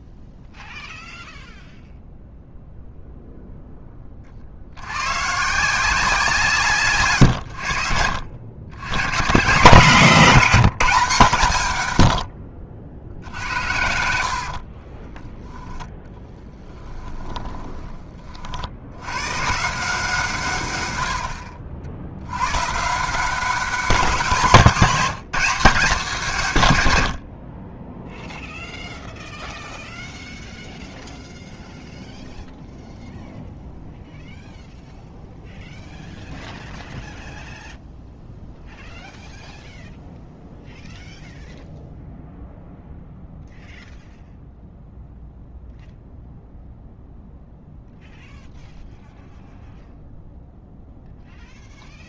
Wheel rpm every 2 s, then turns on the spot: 0, 0, 90, 150, 100, 200, 70, 50, 20, 70, 120, 130, 190, 120, 0, 0, 0, 0, 0, 0, 0, 0, 0, 0, 0, 0.
14-18